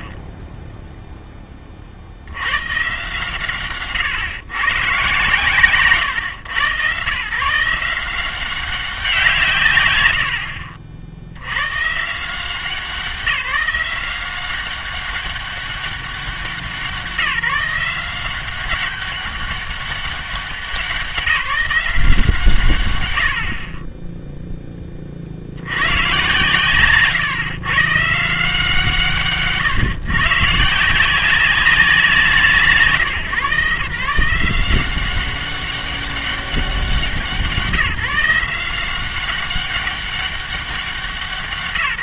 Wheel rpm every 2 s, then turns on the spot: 30, 110, 130, 120, 190, 70, 170, 190, 190, 190, 190, 130, 10, 130, 160, 150, 160, 180, 190, 180, 190.
0-2